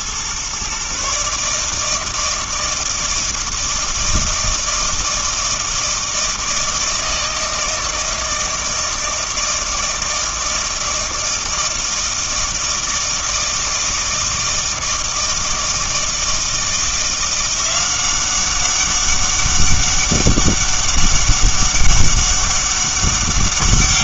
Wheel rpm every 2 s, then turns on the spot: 130, 160, 160, 160, 160, 160, 160, 160, 160, 190, 200, 200.
none